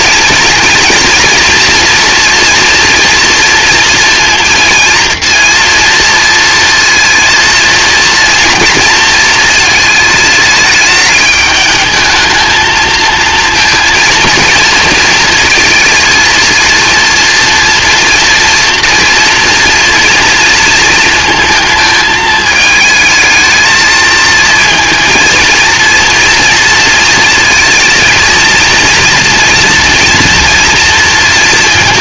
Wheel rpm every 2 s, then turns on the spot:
230, 240, 230, 230, 220, 210, 230, 230, 230, 230, 220, 220, 230, 230, 240, 230.
none